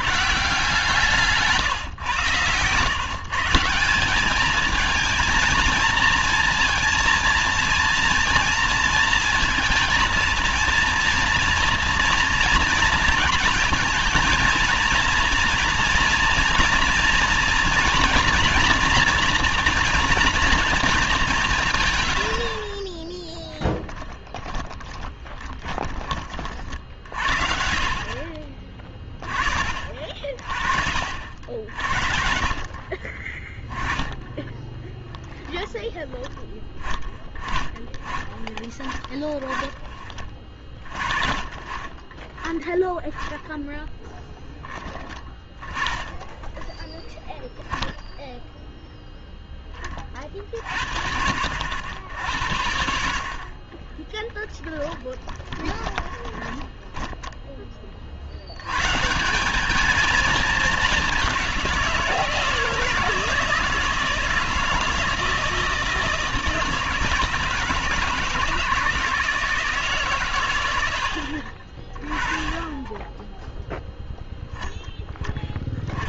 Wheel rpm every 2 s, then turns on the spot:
160, 130, 200, 230, 230, 230, 230, 230, 230, 240, 230, 60, 10, 30, 30, 50, 50, 20, 10, 20, 30, 10, 10, 10, 0, 30, 70, 10, 20, 90, 210, 160, 160, 160, 160, 110, 20, 0.
24-26 54-58